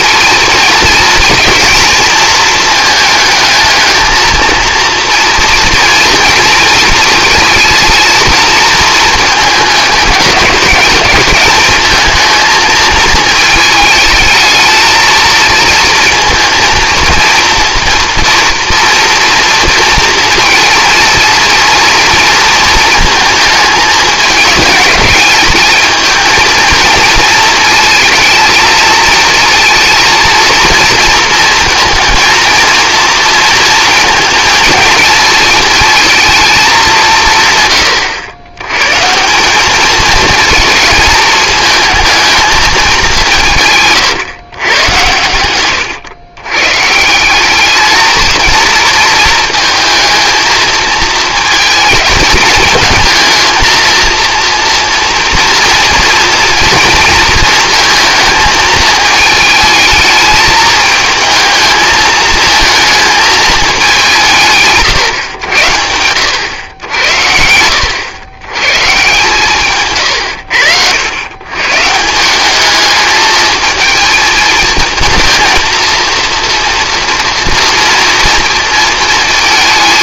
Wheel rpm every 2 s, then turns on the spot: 230, 220, 230, 230, 230, 210, 220, 220, 230, 230, 220, 230, 210, 220, 220, 230, 230, 220, 200, 120, 230, 210, 110, 140, 220, 220, 220, 230, 230, 220, 220, 220, 150, 90, 120, 90, 210, 220, 230, 230.
none